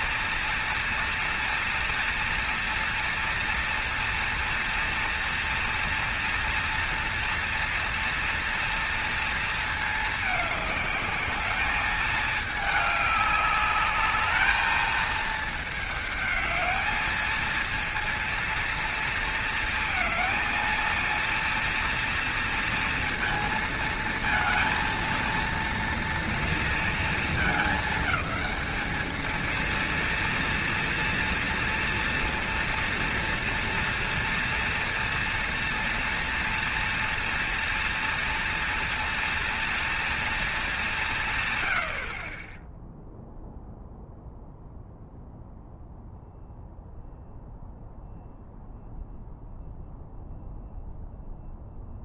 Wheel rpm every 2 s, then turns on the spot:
230, 230, 240, 230, 230, 210, 210, 220, 220, 230, 230, 230, 230, 220, 220, 230, 230, 230, 230, 230, 190, 0, 0, 0, 0, 0.
none